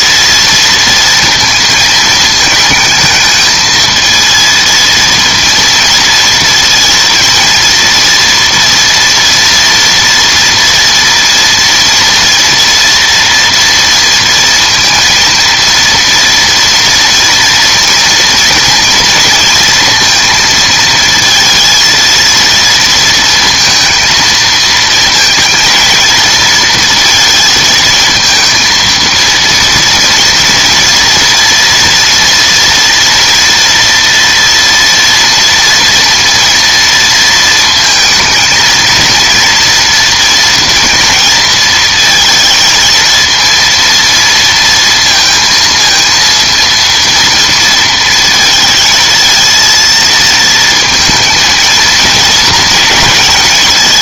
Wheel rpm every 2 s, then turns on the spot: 230, 210, 220, 230, 230, 230, 230, 230, 230, 230, 230, 230, 220, 230, 230, 240, 230, 230, 230, 230, 230, 230, 230, 230, 220, 220, 230.
none